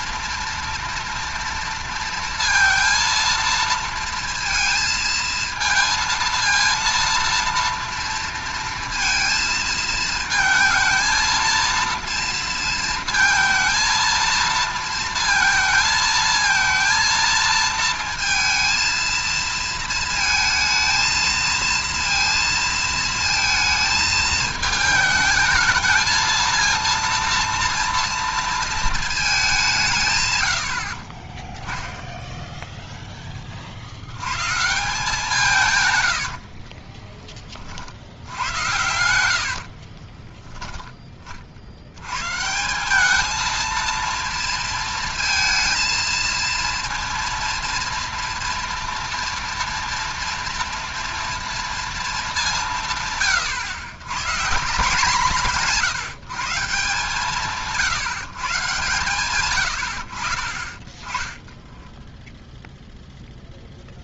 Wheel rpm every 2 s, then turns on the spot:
230, 230, 230, 230, 230, 230, 230, 230, 220, 230, 220, 230, 220, 230, 230, 90, 0, 140, 40, 100, 10, 170, 230, 230, 230, 230, 180, 170, 170, 140, 30, 0.
36-40